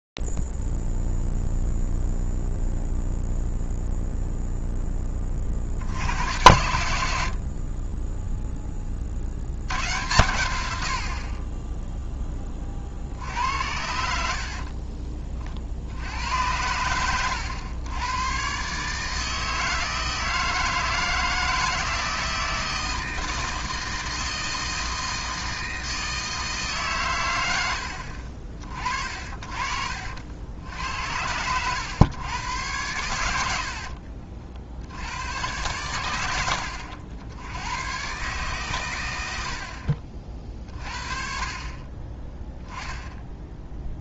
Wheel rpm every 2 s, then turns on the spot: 0, 0, 0, 70, 20, 100, 20, 50, 90, 140, 160, 160, 160, 150, 40, 70, 100, 60, 90, 130, 40, 10.
14-16